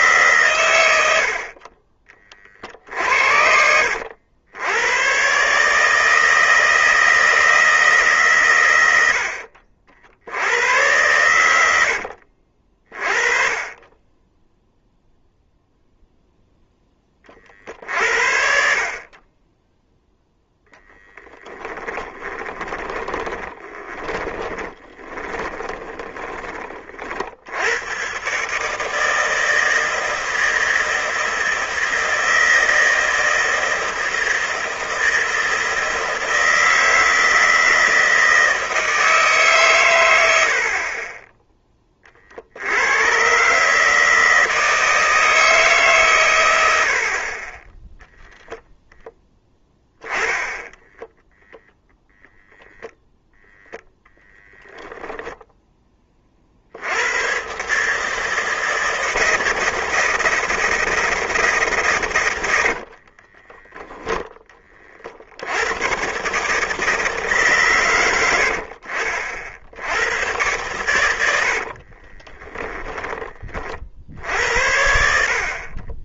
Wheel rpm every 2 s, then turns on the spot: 100, 40, 90, 160, 100, 100, 50, 0, 10, 50, 0, 30, 20, 30, 150, 160, 160, 160, 160, 160, 50, 90, 160, 70, 0, 10, 0, 0, 70, 160, 160, 70, 30, 150, 60, 110, 10, 70.
2-4 22-26 62-64